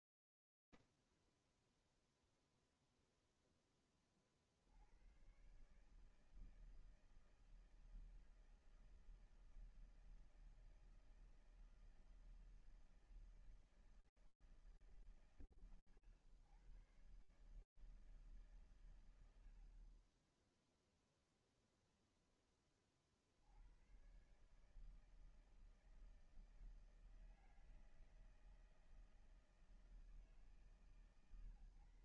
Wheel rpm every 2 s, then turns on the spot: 0, 0, 60, 160, 160, 160, 160, 140, 130, 60, 10, 120, 160, 160, 150, 130.
none